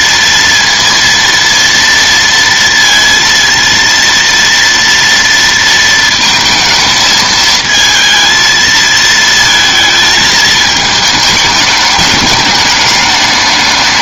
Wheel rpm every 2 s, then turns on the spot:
230, 230, 230, 220, 220, 210, 210.
none